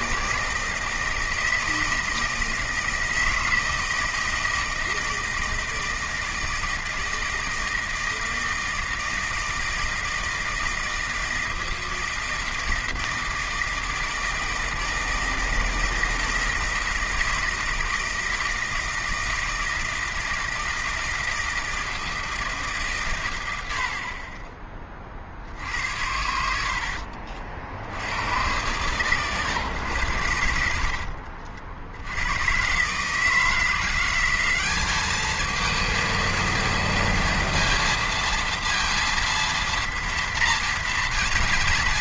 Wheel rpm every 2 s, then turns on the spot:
160, 160, 160, 160, 160, 160, 160, 160, 160, 160, 160, 160, 30, 70, 120, 80, 140, 200, 230, 230, 230.
30-32